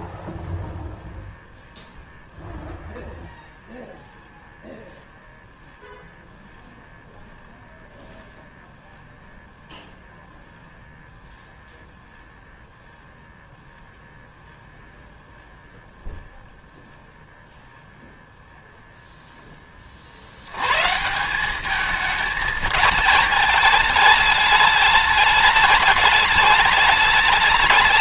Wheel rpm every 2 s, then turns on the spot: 10, 0, 0, 0, 0, 0, 0, 0, 0, 0, 110, 210, 210, 210.
none